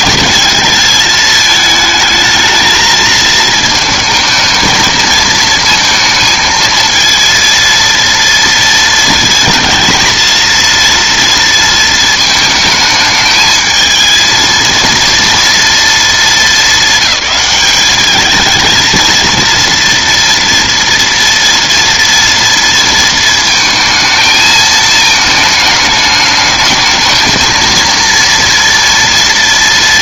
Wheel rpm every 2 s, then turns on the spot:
220, 220, 220, 220, 230, 230, 220, 230, 220, 220, 230, 230, 220, 220, 230.
none